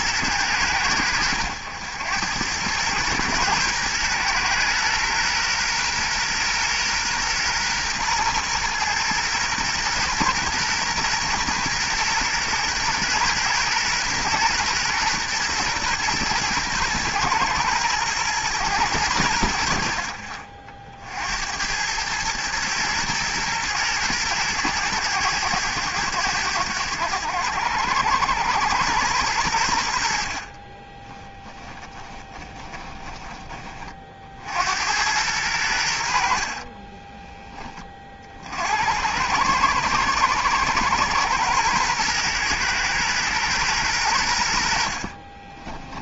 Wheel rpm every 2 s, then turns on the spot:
100, 110, 120, 120, 120, 120, 120, 120, 120, 100, 50, 110, 110, 90, 100, 30, 20, 90, 30, 80, 110, 120, 60.
30-34 36-38